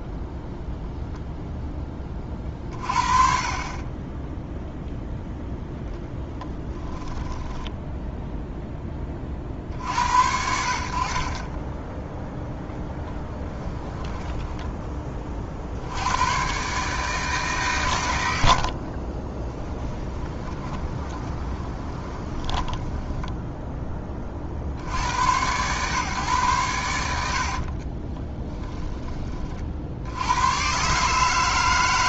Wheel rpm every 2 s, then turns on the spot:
0, 40, 0, 10, 0, 60, 20, 10, 140, 60, 20, 10, 90, 100, 20, 130.
6-8 18-24